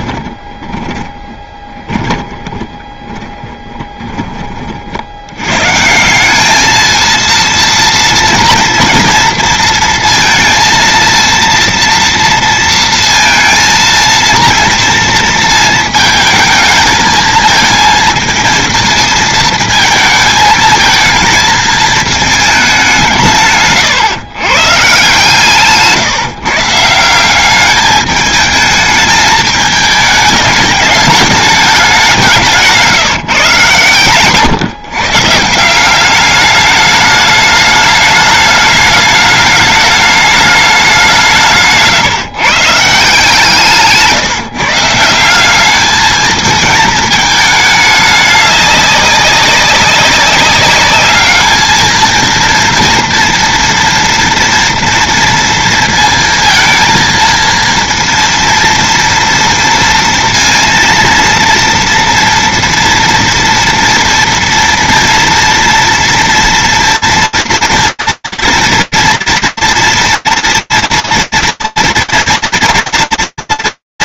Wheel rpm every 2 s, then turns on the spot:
20, 20, 40, 220, 230, 230, 230, 230, 220, 230, 220, 200, 130, 160, 210, 210, 170, 140, 210, 210, 200, 150, 170, 220, 200, 200, 230, 240, 230, 230, 230, 230, 230, 230, 230, 230, 230.
0-4 32-34